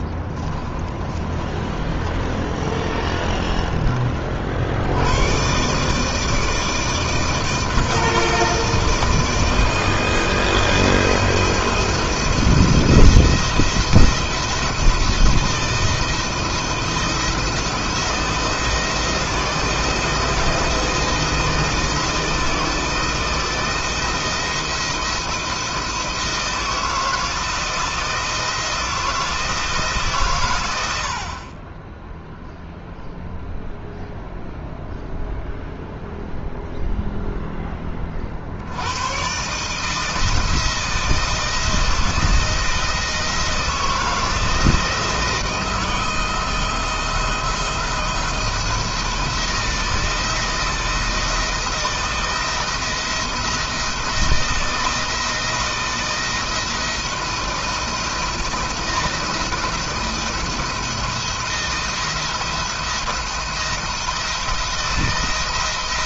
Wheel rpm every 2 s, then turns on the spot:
30, 30, 80, 160, 160, 160, 170, 160, 170, 170, 160, 160, 170, 160, 170, 90, 0, 0, 0, 90, 160, 160, 170, 170, 170, 170, 160, 160, 160, 160, 160, 170, 170.
0-4